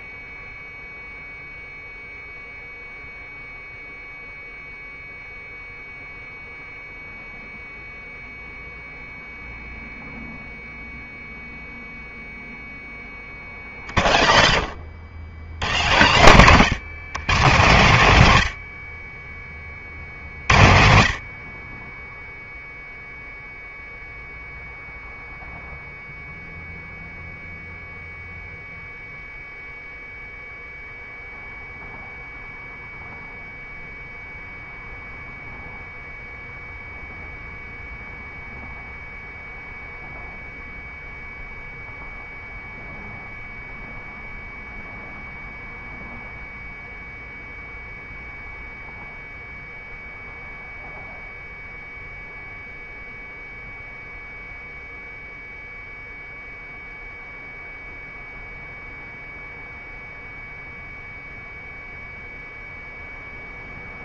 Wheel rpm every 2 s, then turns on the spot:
0, 0, 0, 0, 0, 0, 20, 100, 160, 40, 60, 0, 0, 0, 0, 0, 0, 0, 0, 0, 0, 0, 0, 0, 0, 0, 0, 0, 0, 0, 0, 0.
14-16